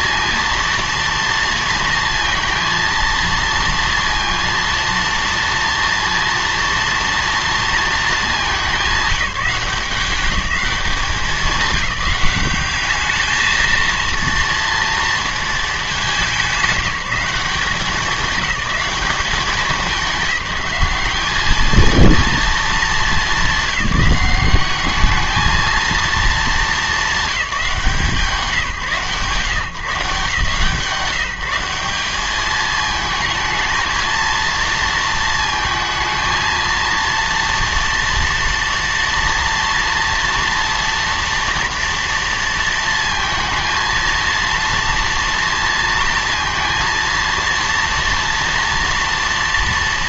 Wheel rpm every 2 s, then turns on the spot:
230, 230, 230, 230, 200, 200, 210, 230, 180, 210, 200, 230, 190, 210, 150, 160, 210, 230, 230, 240, 230, 230, 230, 230, 230.
none